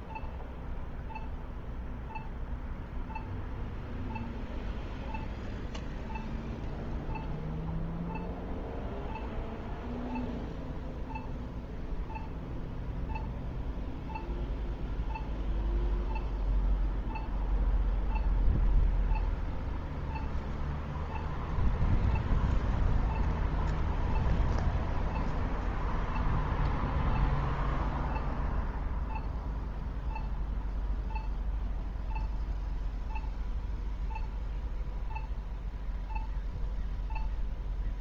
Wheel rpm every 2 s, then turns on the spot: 0, 0, 0, 0, 0, 0, 0, 0, 0, 0, 0, 0, 0, 0, 0, 0, 0, 0, 0.
none